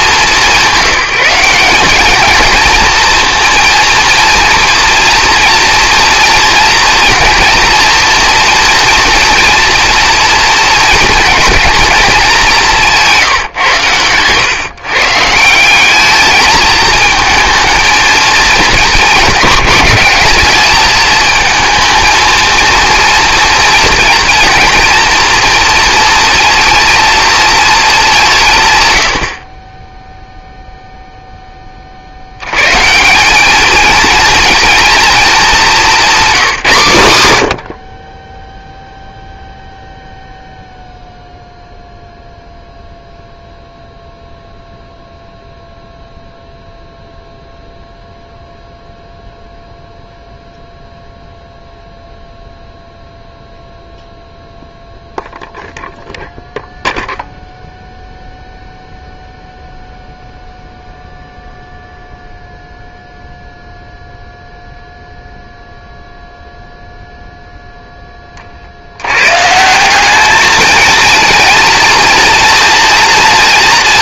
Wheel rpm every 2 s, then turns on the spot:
190, 230, 230, 230, 230, 230, 190, 130, 220, 210, 210, 230, 230, 230, 150, 0, 100, 230, 180, 10, 0, 0, 0, 0, 0, 0, 0, 0, 0, 0, 0, 0, 0, 0, 40, 220, 230.
none